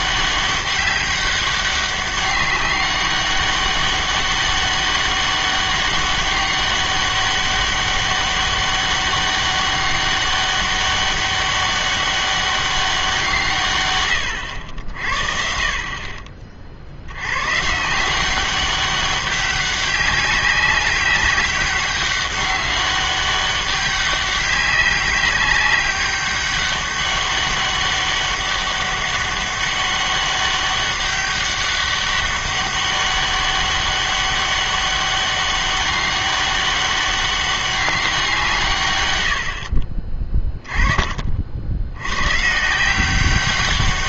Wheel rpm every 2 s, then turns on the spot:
200, 200, 200, 200, 200, 200, 190, 80, 60, 190, 190, 200, 190, 200, 200, 200, 200, 200, 200, 150, 20, 150.
none